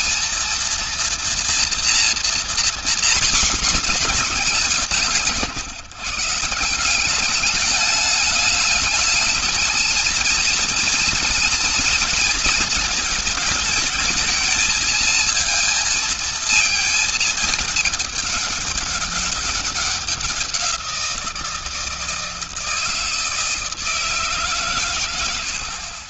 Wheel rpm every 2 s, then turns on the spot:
230, 240, 180, 160, 210, 220, 230, 220, 220, 200, 180, 160, 140.
none